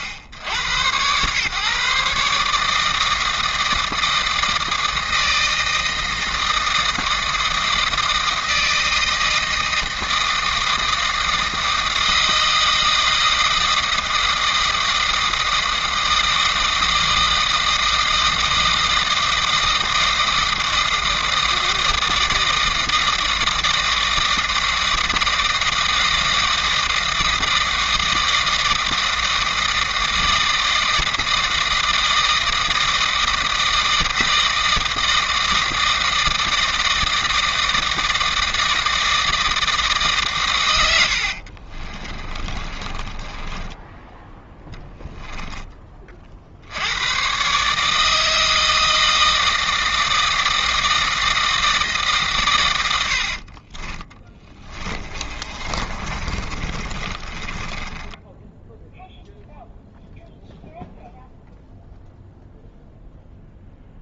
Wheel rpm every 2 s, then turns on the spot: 110, 150, 160, 160, 160, 160, 160, 160, 160, 160, 160, 160, 160, 160, 160, 160, 160, 160, 160, 160, 120, 30, 10, 70, 160, 160, 130, 20, 30, 0, 0, 0.
42-44 54-58